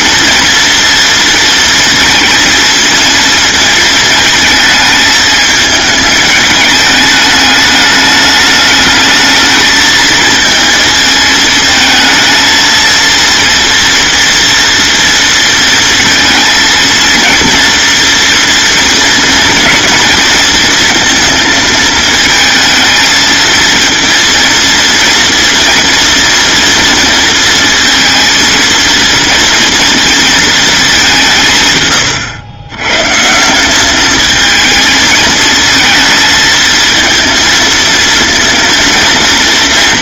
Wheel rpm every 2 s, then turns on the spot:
230, 230, 220, 210, 210, 220, 220, 230, 220, 230, 230, 220, 240, 230, 230, 220, 110, 220, 220, 230.
none